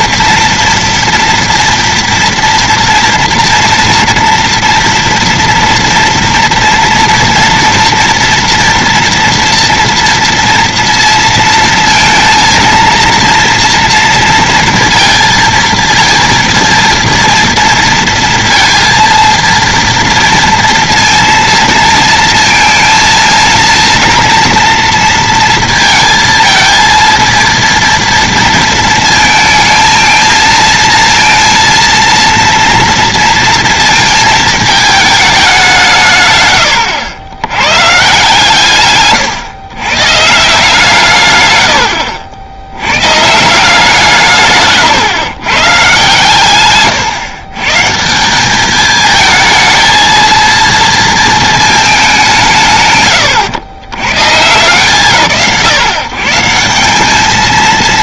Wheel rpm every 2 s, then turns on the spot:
230, 230, 230, 230, 230, 230, 230, 230, 230, 230, 230, 230, 230, 220, 230, 230, 230, 220, 110, 140, 160, 90, 130, 120, 200, 220, 130, 150, 180.
none